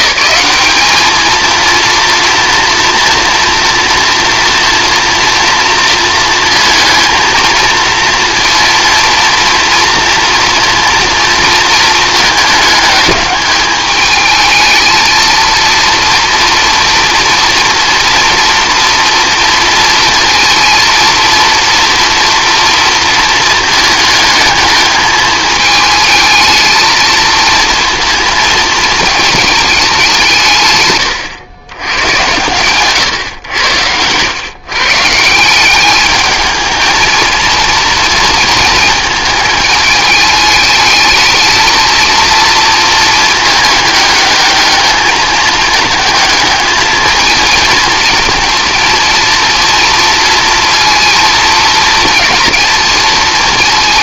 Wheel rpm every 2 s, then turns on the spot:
200, 240, 230, 230, 230, 230, 210, 220, 240, 240, 230, 230, 220, 220, 220, 140, 120, 130, 220, 220, 220, 230, 210, 220, 230, 230, 230.
none